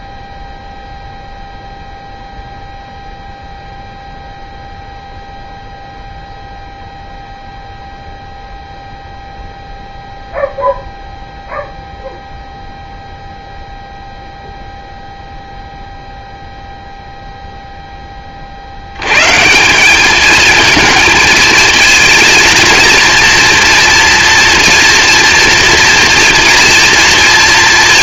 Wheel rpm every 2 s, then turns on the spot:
0, 0, 0, 0, 0, 0, 0, 0, 0, 50, 220, 230, 240, 230.
none